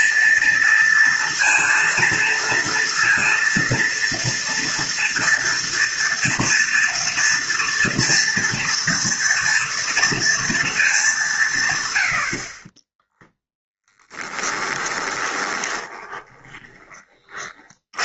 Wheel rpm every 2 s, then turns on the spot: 230, 230, 230, 230, 230, 200, 20, 20, 30.
12-16